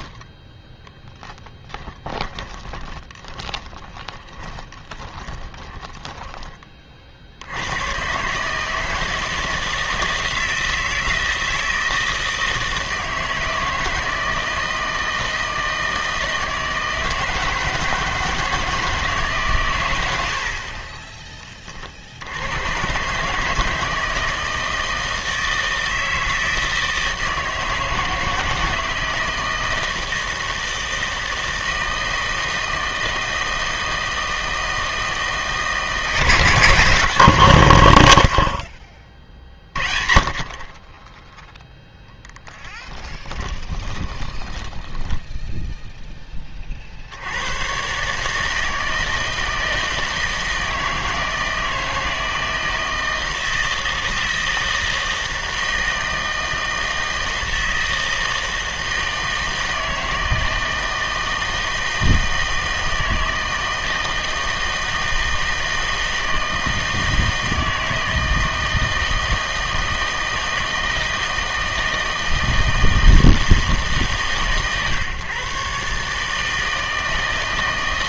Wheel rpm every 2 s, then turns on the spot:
10, 20, 20, 30, 150, 170, 160, 160, 160, 160, 60, 110, 160, 160, 160, 160, 160, 160, 160, 50, 40, 10, 10, 20, 160, 160, 160, 160, 160, 160, 160, 160, 160, 160, 160, 160, 160, 140, 160.
2-6 42-46